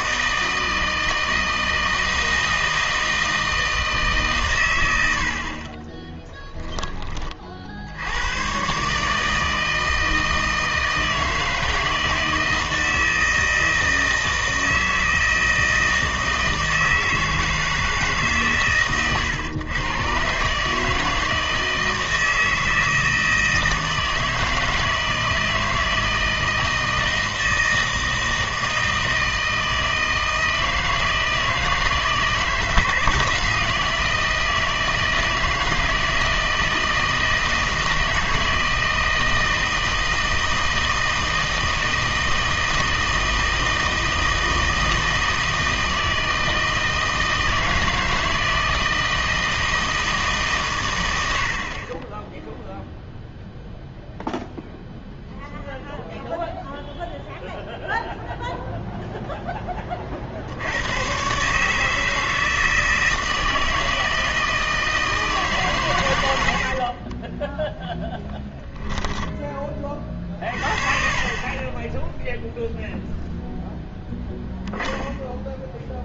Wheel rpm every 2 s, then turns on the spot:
160, 160, 100, 10, 130, 160, 160, 160, 160, 120, 150, 160, 160, 160, 160, 160, 160, 160, 160, 160, 160, 160, 160, 160, 160, 130, 0, 0, 0, 0, 100, 160, 160, 50, 10, 40, 0, 0.
66-70